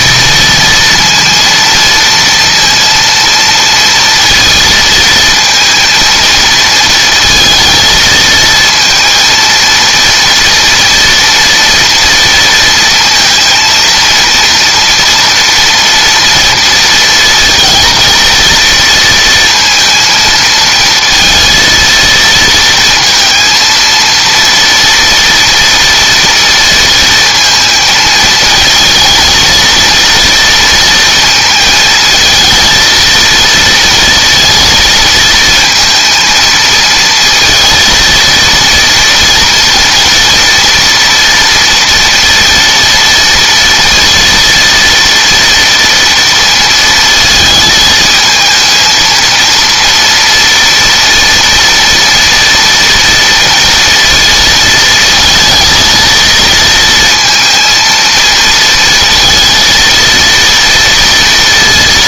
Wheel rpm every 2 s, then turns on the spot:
230, 230, 230, 220, 230, 230, 230, 230, 230, 230, 230, 230, 230, 230, 220, 230, 230, 220, 230, 230, 230, 230, 230, 230, 230, 230, 230, 220, 230, 230, 230.
none